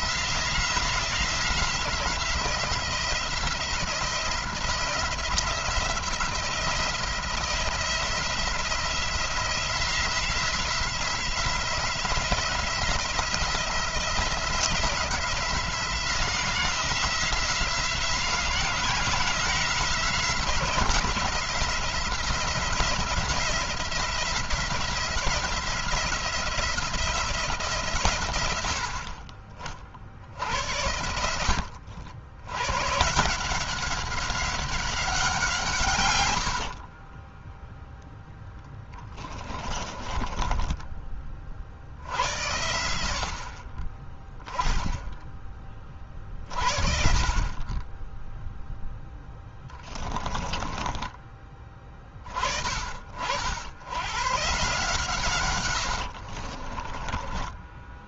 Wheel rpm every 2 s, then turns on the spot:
170, 170, 180, 170, 170, 170, 180, 170, 170, 170, 170, 170, 170, 170, 60, 70, 120, 190, 50, 10, 20, 80, 20, 50, 0, 20, 50, 140, 30.
36-42 50-52 56-58